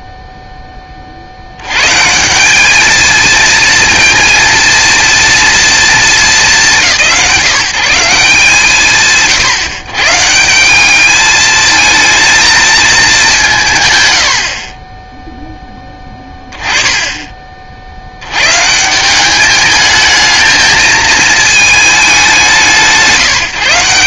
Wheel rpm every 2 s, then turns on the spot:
10, 210, 230, 200, 170, 180, 220, 50, 20, 130, 220, 160.
16-18